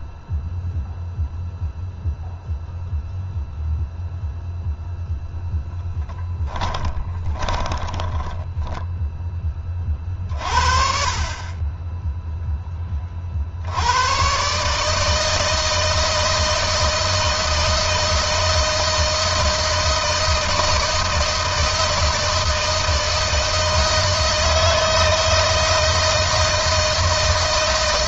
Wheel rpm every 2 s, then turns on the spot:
0, 0, 0, 20, 10, 50, 20, 150, 160, 160, 160, 160, 160, 160.
6-10